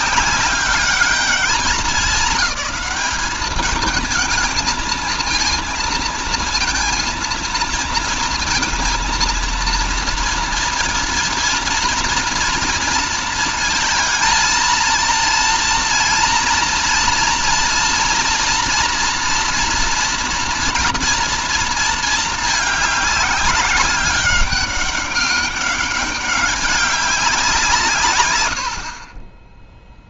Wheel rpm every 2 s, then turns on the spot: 210, 210, 220, 230, 230, 230, 230, 230, 240, 230, 230, 210, 200, 200, 80.
none